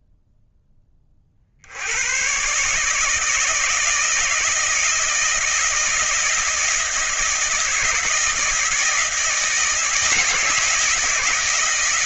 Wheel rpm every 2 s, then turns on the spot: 10, 140, 160, 160, 160, 160.
none